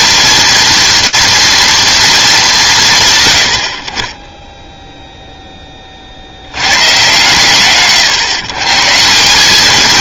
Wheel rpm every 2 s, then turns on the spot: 230, 170, 0, 100, 140.
none